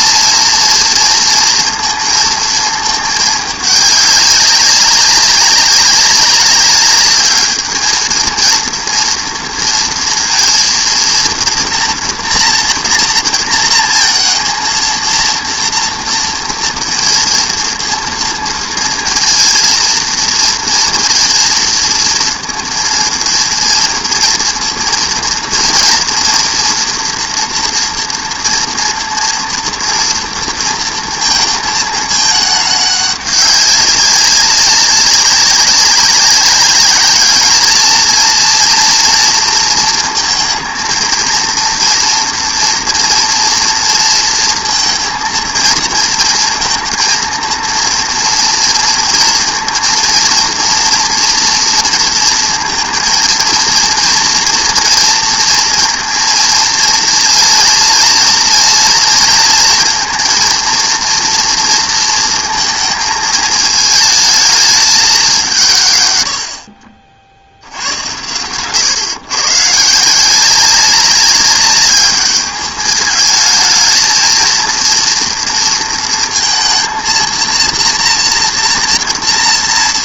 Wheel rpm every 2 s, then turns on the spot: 230, 220, 200, 200, 230, 230, 230, 230, 230, 230, 230, 230, 230, 230, 230, 230, 210, 200, 200, 230, 230, 230, 230, 230, 230, 230, 230, 230, 230, 230, 230, 230, 220, 70, 120, 190, 210, 230, 230, 230.
none